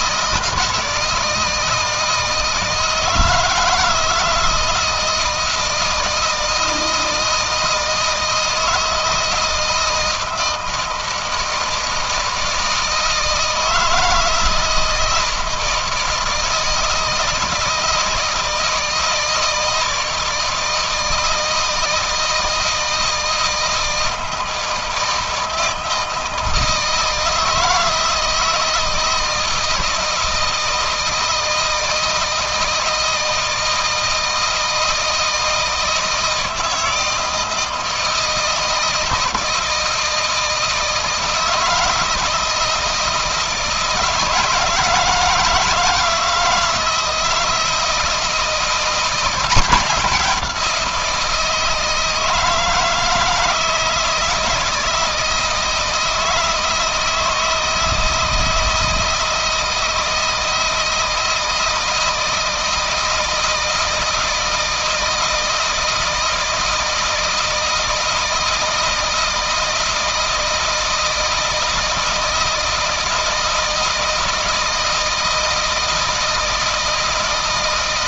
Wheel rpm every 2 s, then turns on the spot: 160, 160, 160, 160, 160, 160, 160, 160, 160, 160, 160, 160, 160, 160, 160, 160, 160, 160, 160, 160, 160, 160, 160, 170, 170, 180, 160, 160, 160, 160, 160, 160, 160, 160, 160, 160, 160, 160, 160.
none